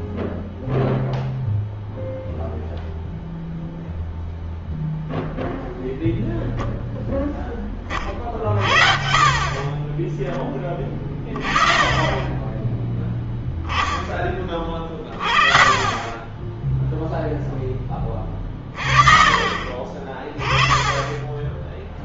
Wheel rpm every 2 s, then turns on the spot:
0, 0, 0, 0, 50, 20, 20, 20, 10, 30, 30.
none